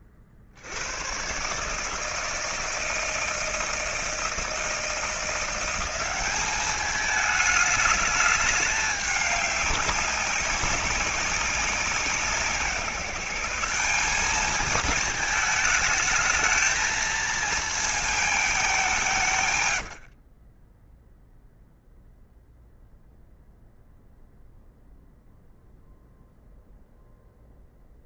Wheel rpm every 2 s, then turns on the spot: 70, 160, 160, 200, 210, 200, 170, 220, 220, 210, 20, 0, 0, 0.
20-22